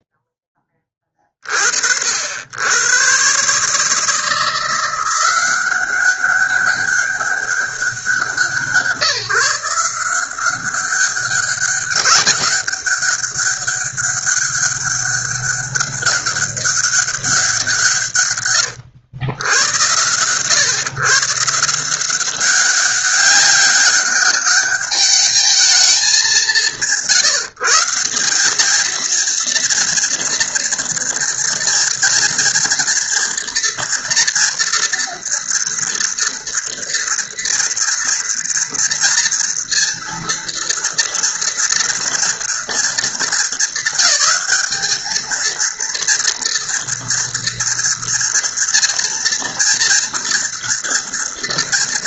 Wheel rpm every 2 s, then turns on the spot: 0, 70, 160, 190, 170, 180, 200, 200, 200, 140, 110, 180, 200, 200, 180, 230, 230, 230, 230, 230, 230, 230, 210, 230, 230, 230.
none